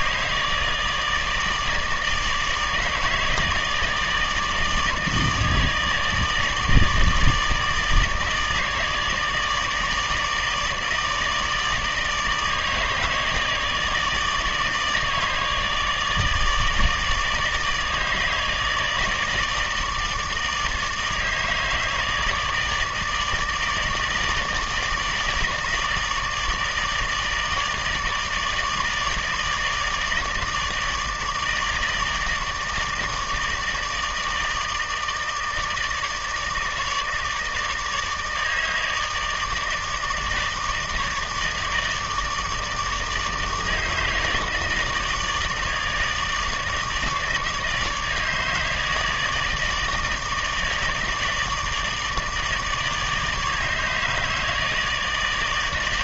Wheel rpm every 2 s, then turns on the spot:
150, 160, 150, 160, 150, 160, 160, 150, 150, 150, 150, 150, 160, 160, 150, 150, 150, 150, 160, 160, 150, 150, 150, 150, 150, 160, 150, 160.
none